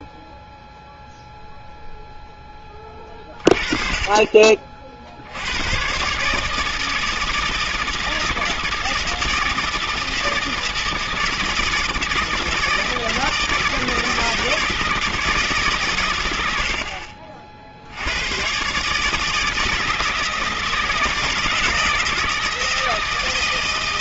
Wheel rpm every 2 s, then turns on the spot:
0, 20, 50, 160, 160, 160, 160, 160, 80, 130, 160, 160.
none